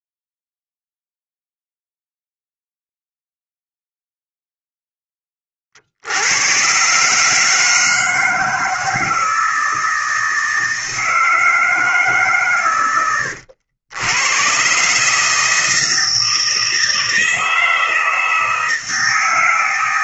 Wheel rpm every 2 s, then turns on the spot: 0, 0, 0, 110, 160, 160, 130, 120, 160, 160.
none